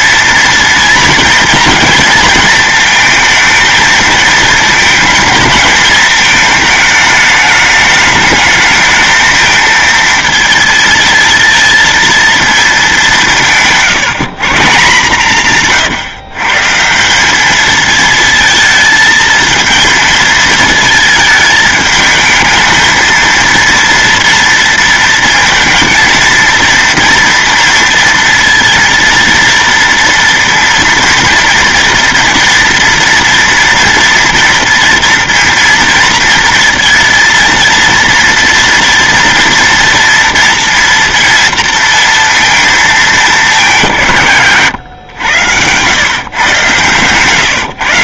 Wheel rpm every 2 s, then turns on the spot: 230, 220, 230, 210, 220, 230, 210, 160, 150, 220, 220, 220, 230, 230, 230, 230, 230, 230, 230, 230, 230, 220, 120, 130.
none